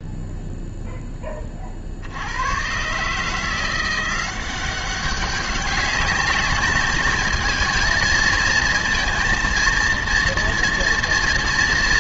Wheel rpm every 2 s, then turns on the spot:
10, 150, 200, 220, 230, 210.
none